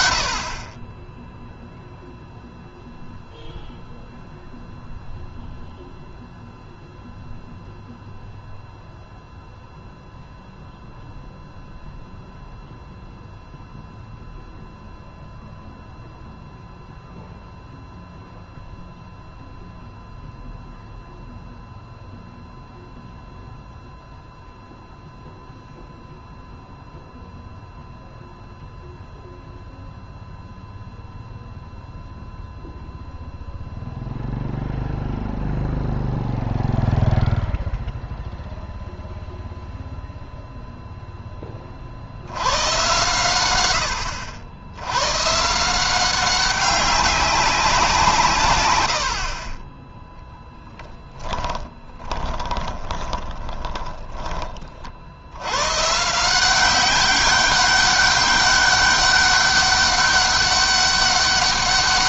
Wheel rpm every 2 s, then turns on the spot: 60, 0, 0, 0, 0, 0, 0, 0, 0, 0, 0, 0, 0, 0, 0, 0, 0, 0, 0, 0, 0, 90, 90, 190, 140, 10, 20, 30, 170, 200, 200.
50-54